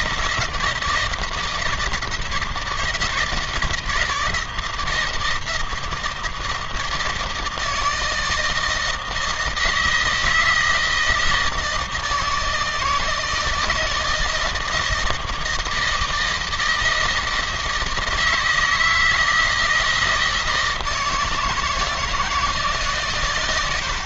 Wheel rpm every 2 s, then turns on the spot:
160, 160, 160, 160, 160, 160, 160, 160, 160, 160, 160, 150.
none